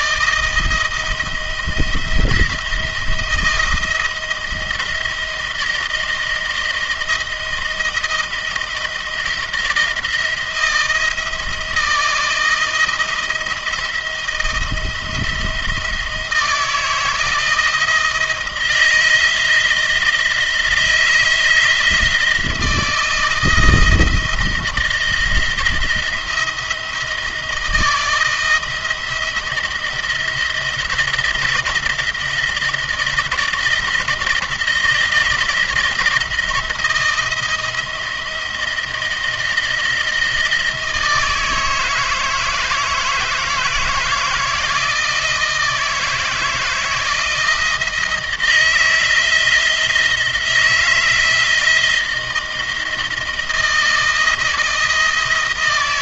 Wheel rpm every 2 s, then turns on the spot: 160, 170, 170, 170, 160, 170, 160, 160, 160, 160, 170, 160, 170, 170, 160, 170, 170, 170, 170, 160, 160, 160, 160, 160, 160, 170, 170, 170.
none